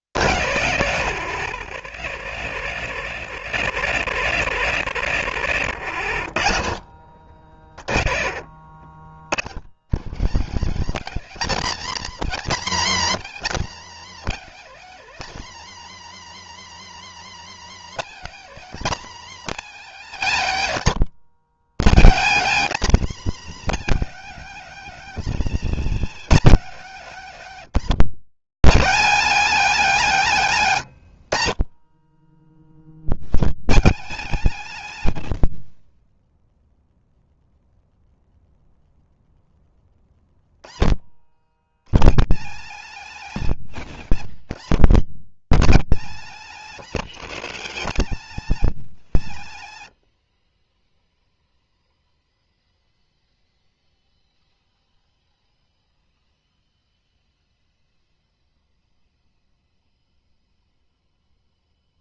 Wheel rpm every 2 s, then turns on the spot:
150, 240, 240, 190, 190, 240, 280, 270, 300, 280, 240, 260, 270, 260, 220, 200, 170, 230, 10, 0, 80, 210, 210, 260, 280, 50, 0, 0, 0, 0, 0.
20-24